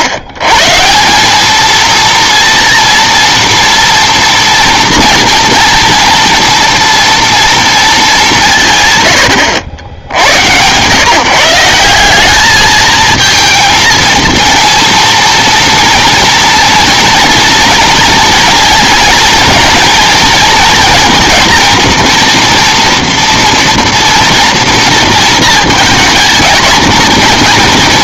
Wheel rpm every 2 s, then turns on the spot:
140, 230, 230, 230, 170, 110, 210, 230, 230, 230, 230, 230, 230, 220.
none